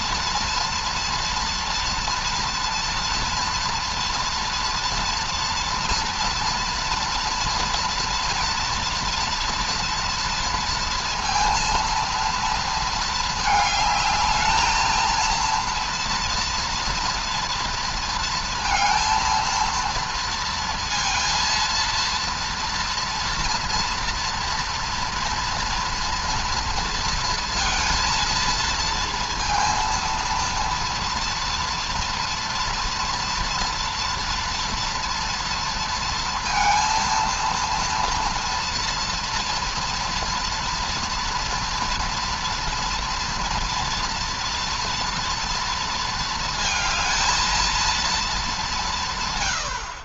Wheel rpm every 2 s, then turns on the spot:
240, 230, 230, 230, 230, 230, 230, 220, 230, 230, 230, 230, 230, 240, 230, 230, 230, 230, 230, 230, 230, 230, 230, 230, 210.
none